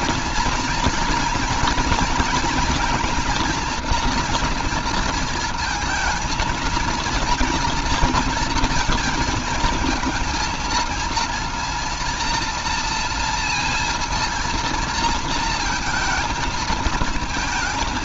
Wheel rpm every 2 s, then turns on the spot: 220, 230, 230, 220, 230, 230, 230, 220, 220.
none